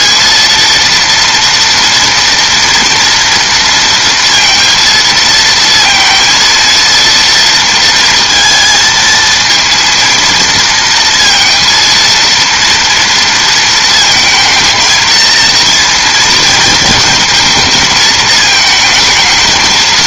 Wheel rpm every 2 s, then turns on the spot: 230, 230, 230, 230, 220, 230, 230, 230, 220, 220.
none